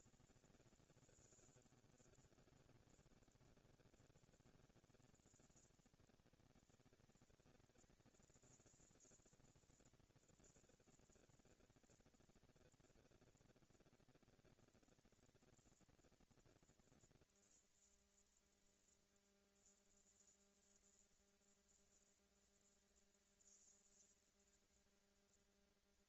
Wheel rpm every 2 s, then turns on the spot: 210, 160, 170, 210, 220, 230, 230, 240, 230, 230, 230, 230, 230.
none